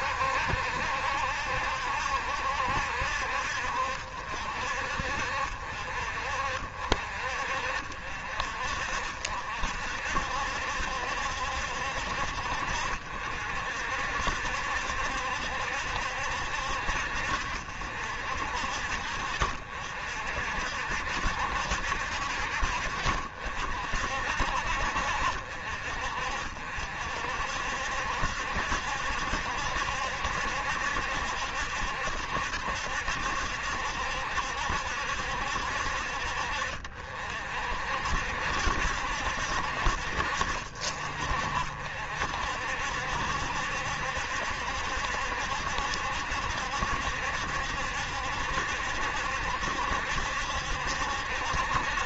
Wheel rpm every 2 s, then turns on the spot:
70, 70, 60, 50, 60, 70, 60, 70, 60, 60, 70, 60, 60, 60, 70, 70, 60, 70, 50, 60, 50, 60, 70, 70, 70, 70.
none